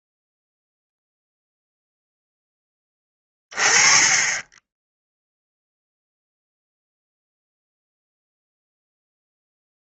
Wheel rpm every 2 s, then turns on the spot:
0, 10, 10, 0, 0.
none